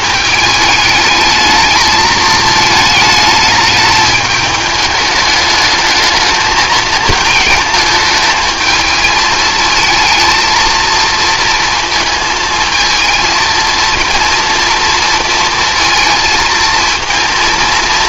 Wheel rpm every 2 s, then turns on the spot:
220, 220, 210, 230, 220, 230, 220, 230, 230.
none